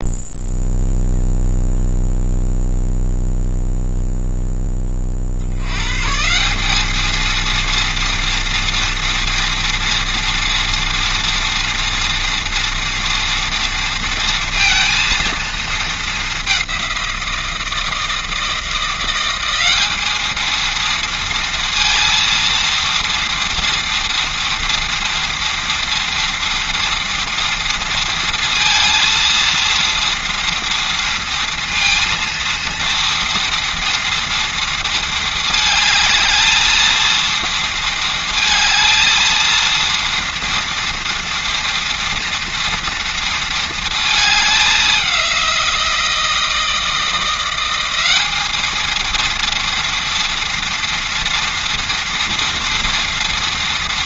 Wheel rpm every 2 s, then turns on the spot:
0, 0, 20, 210, 230, 230, 230, 230, 190, 170, 230, 230, 230, 230, 230, 230, 230, 230, 230, 230, 230, 230, 200, 170, 220, 230, 230.
none